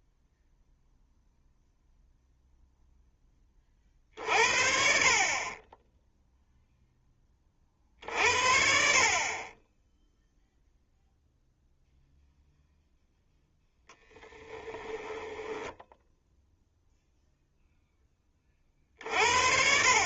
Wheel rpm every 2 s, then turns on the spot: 0, 0, 50, 10, 60, 0, 0, 10, 0, 60.
14-16